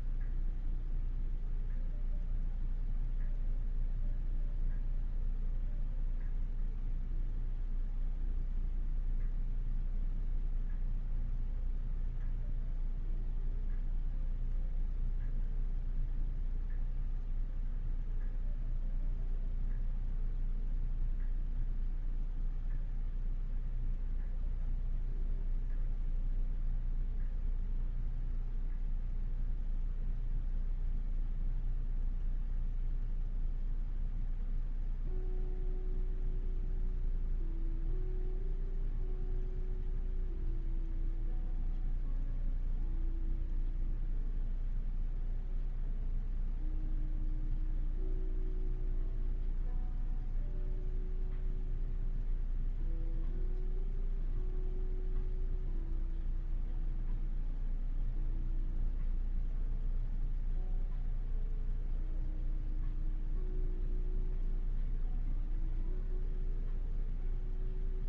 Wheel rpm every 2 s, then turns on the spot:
0, 0, 0, 0, 0, 0, 0, 0, 0, 0, 0, 0, 0, 0, 0, 0, 0, 0, 0, 0, 0, 0, 0, 0, 0, 0, 0, 0, 0, 0, 0, 0, 0, 0.
none